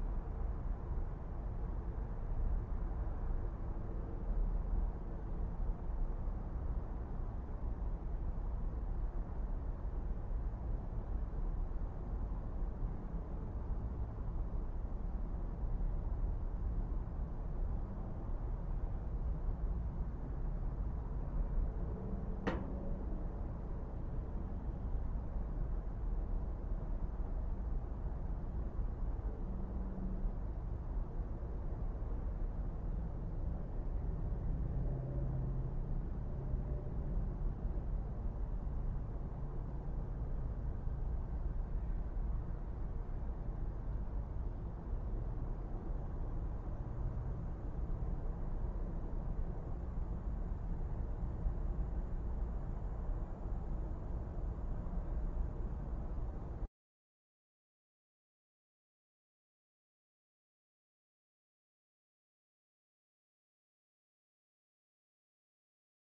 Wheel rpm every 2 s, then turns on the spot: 0, 0, 0, 0, 0, 0, 0, 0, 0, 0, 0, 0, 0, 0, 0, 0, 0, 0, 0, 0, 0, 0, 0, 0, 0, 0, 0, 0, 0, 0, 0, 0, 0.
none